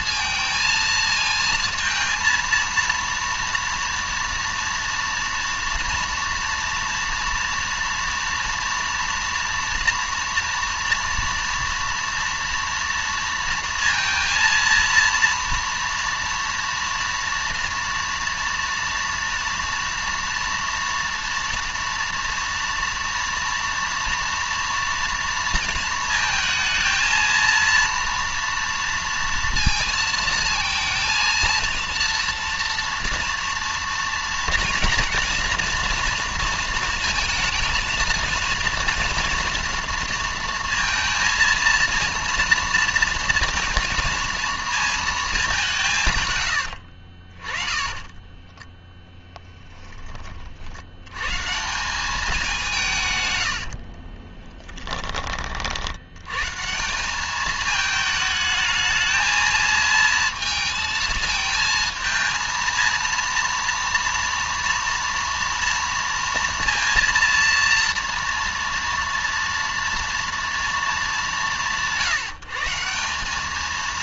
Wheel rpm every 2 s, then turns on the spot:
220, 230, 230, 230, 230, 230, 230, 230, 230, 230, 230, 230, 230, 220, 230, 230, 230, 240, 230, 230, 230, 230, 230, 90, 20, 80, 170, 10, 150, 220, 220, 230, 230, 230, 230, 230, 170.
46-50 54-56